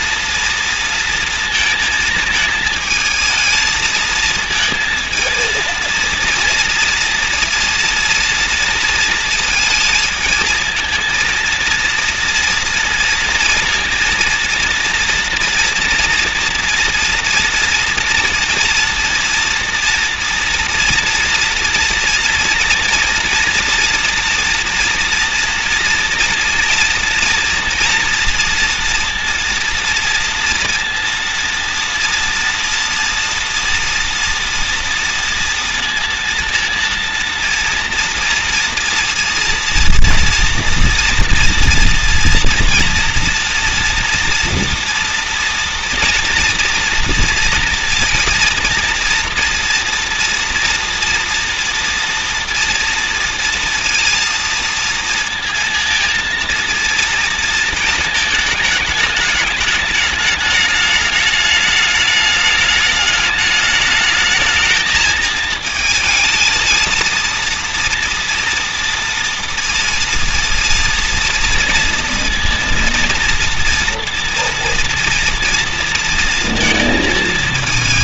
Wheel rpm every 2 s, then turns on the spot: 230, 220, 230, 230, 230, 230, 230, 230, 230, 230, 230, 230, 240, 230, 230, 230, 230, 230, 230, 230, 240, 240, 230, 230, 230, 240, 240, 230, 230, 220, 210, 210, 220, 220, 230, 230, 230, 230, 230.
none